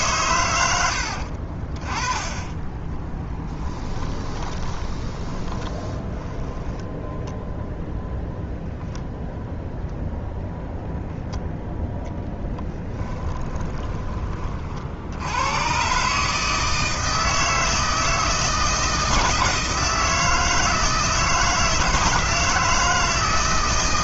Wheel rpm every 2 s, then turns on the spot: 90, 20, 20, 0, 0, 0, 20, 40, 160, 160, 160, 160.
2-6 12-14